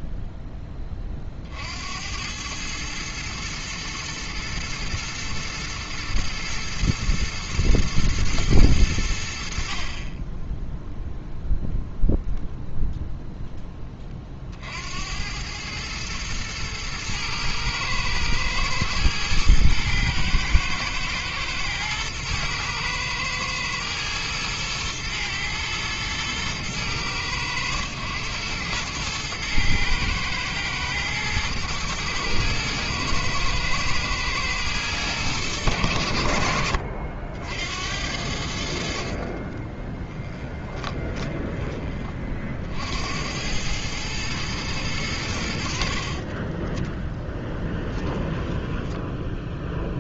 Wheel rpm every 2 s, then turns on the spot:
20, 110, 110, 110, 100, 0, 0, 70, 110, 110, 110, 110, 110, 110, 110, 120, 110, 110, 60, 60, 20, 70, 110, 10, 10.
40-42 48-50